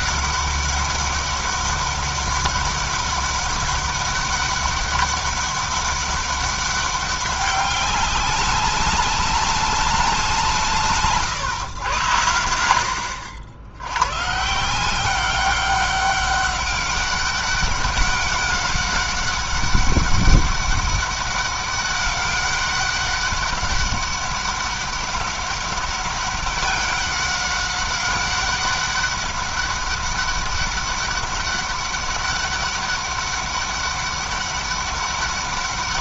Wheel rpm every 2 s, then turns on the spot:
200, 200, 200, 200, 200, 150, 90, 180, 200, 200, 200, 200, 200, 200, 190, 200, 200, 200.
none